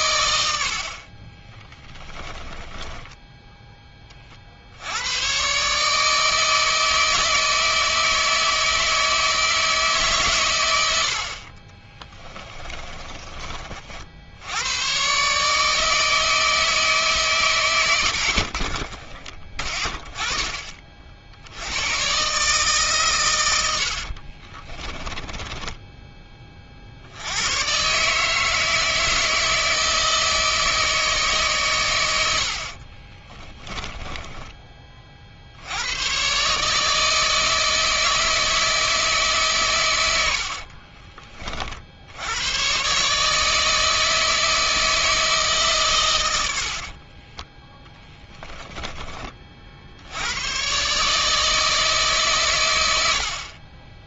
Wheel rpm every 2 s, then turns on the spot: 50, 10, 80, 160, 160, 80, 20, 120, 150, 30, 40, 130, 20, 50, 160, 160, 40, 40, 150, 160, 40, 130, 160, 70, 20, 140, 90.
2-4 12-14 18-20 24-26 32-34 40-42 46-48